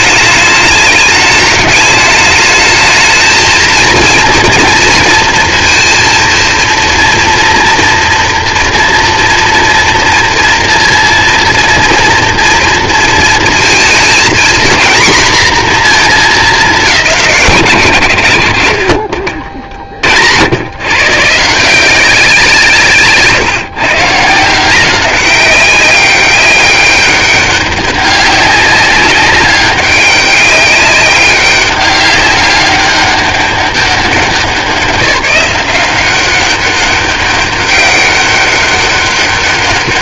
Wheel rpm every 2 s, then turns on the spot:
210, 210, 230, 230, 230, 230, 230, 240, 230, 90, 80, 180, 160, 200, 200, 190, 200, 190, 190, 200.
none